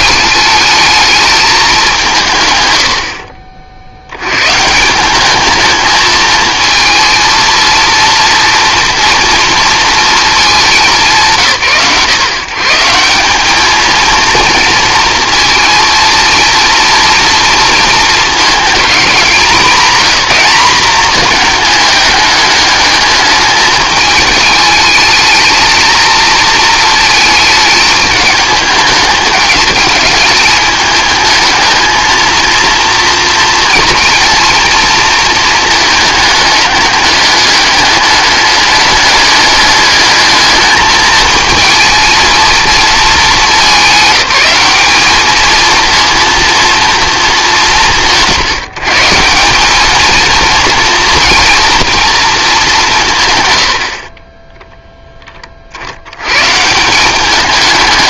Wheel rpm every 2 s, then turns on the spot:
220, 100, 170, 220, 230, 190, 160, 230, 230, 220, 210, 210, 220, 220, 220, 210, 230, 230, 210, 210, 210, 230, 210, 230, 160, 230, 180, 10, 170.
none